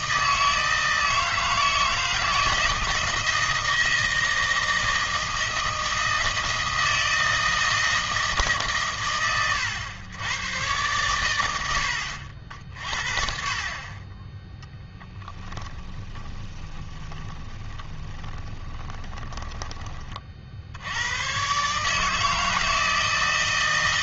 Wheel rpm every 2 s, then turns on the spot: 160, 160, 160, 160, 140, 120, 60, 10, 20, 20, 70, 160.
16-20